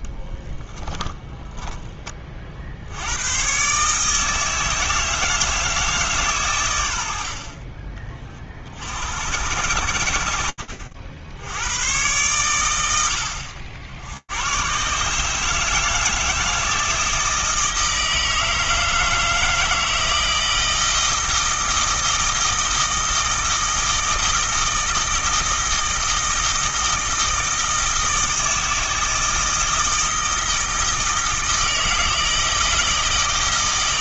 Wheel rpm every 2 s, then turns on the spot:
10, 70, 160, 100, 60, 60, 90, 130, 160, 160, 160, 160, 160, 160, 160, 160, 160.
0-2